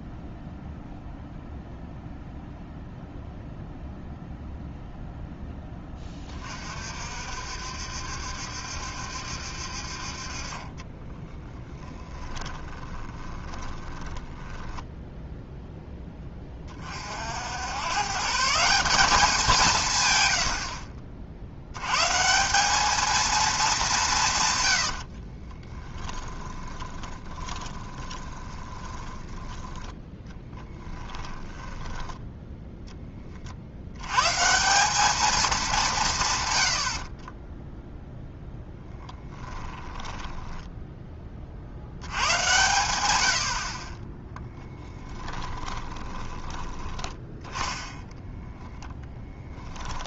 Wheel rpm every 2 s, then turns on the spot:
0, 0, 0, 50, 70, 30, 20, 10, 30, 190, 60, 200, 100, 20, 20, 10, 10, 190, 50, 0, 10, 70, 10, 10, 10.
10-14 24-32 36-38 44-46